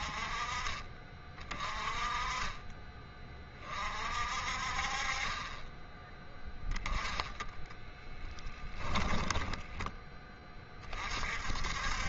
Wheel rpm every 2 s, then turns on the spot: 30, 20, 40, 10, 10, 30.
8-10